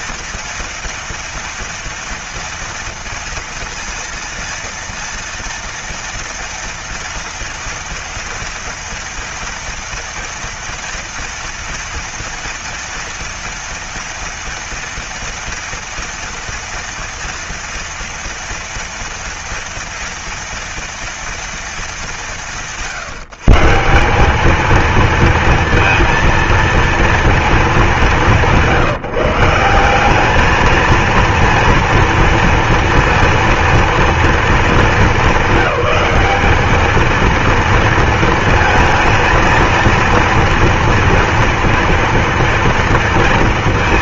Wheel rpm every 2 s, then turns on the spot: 230, 230, 230, 230, 230, 230, 230, 230, 230, 230, 230, 150, 230, 230, 160, 220, 230, 210, 220, 220, 230, 230.
none